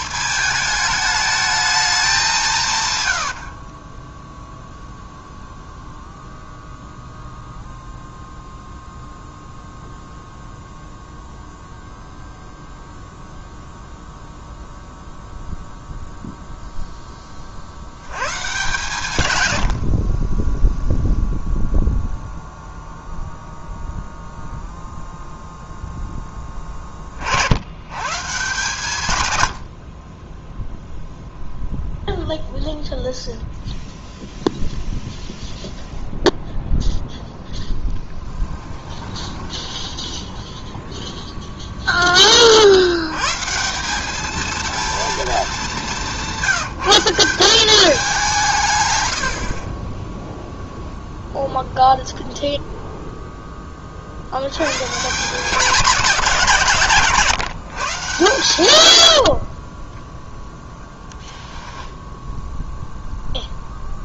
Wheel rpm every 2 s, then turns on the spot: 220, 130, 0, 0, 0, 0, 0, 0, 10, 140, 0, 0, 0, 30, 130, 0, 0, 0, 0, 10, 10, 70, 230, 170, 110, 0, 0, 120, 170, 80, 10, 0.
2-4 38-40 58-60